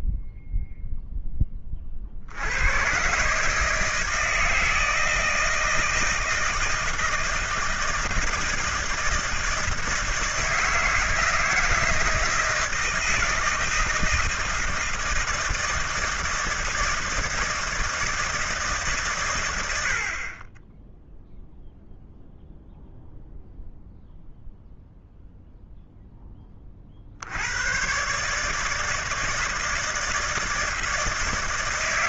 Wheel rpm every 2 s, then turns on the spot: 0, 110, 160, 160, 160, 160, 160, 160, 160, 150, 10, 0, 0, 40, 160, 160.
none